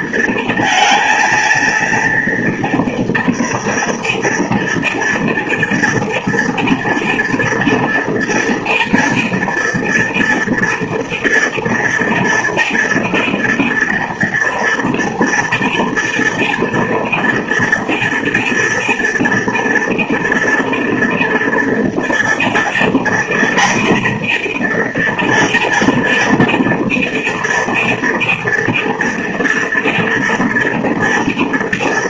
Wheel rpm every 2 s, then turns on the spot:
230, 230, 230, 230, 230, 230, 230, 230, 230, 230, 230, 240, 240, 240, 230, 230.
none